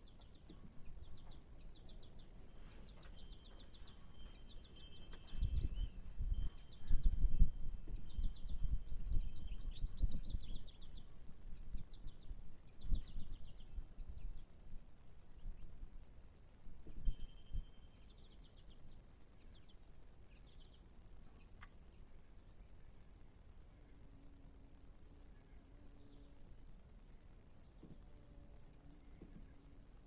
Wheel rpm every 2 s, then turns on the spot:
0, 0, 0, 0, 0, 0, 0, 0, 0, 0, 0, 0, 0, 0, 0.
none